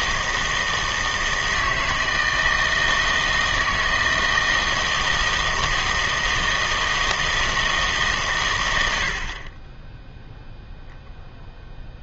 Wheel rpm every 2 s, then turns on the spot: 160, 160, 160, 160, 90, 0.
none